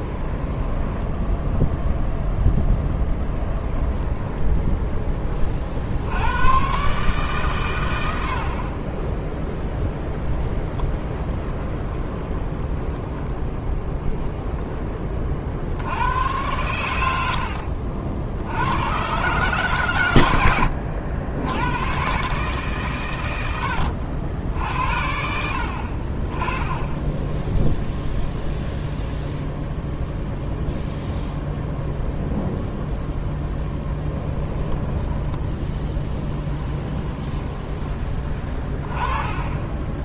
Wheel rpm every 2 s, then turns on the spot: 10, 10, 10, 120, 40, 10, 20, 10, 100, 90, 90, 140, 70, 20, 0, 0, 0, 10, 10, 20.
4-6 10-14 20-22 34-38